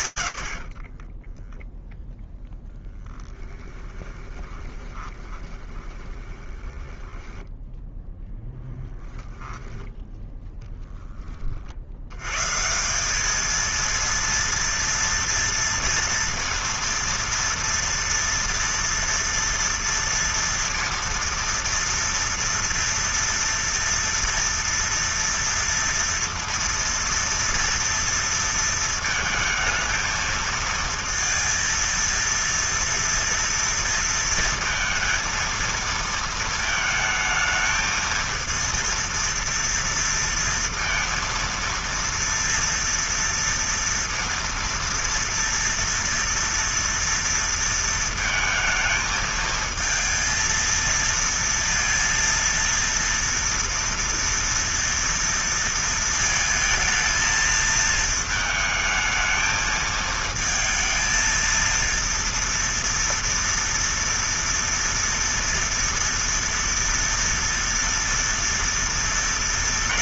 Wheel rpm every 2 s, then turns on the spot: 70, 0, 20, 10, 0, 20, 190, 230, 230, 230, 230, 230, 230, 230, 220, 230, 230, 230, 220, 230, 230, 230, 230, 230, 220, 230, 230, 230, 220, 220, 230, 230, 230, 230, 230.
4-8